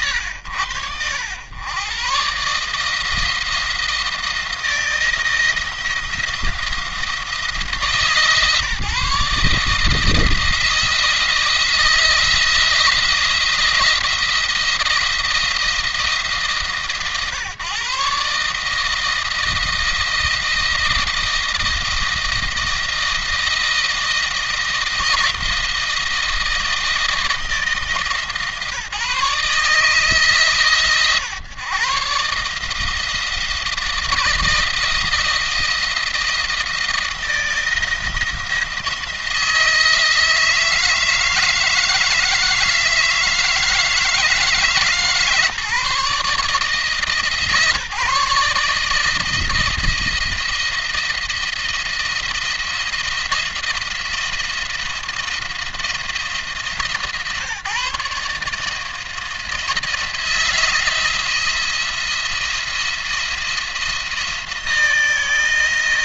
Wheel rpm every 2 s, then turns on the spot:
90, 150, 170, 170, 150, 170, 170, 170, 140, 150, 160, 160, 160, 170, 140, 150, 150, 170, 170, 170, 160, 160, 150, 150, 150, 170, 170, 170, 150, 150, 170, 170, 170.
none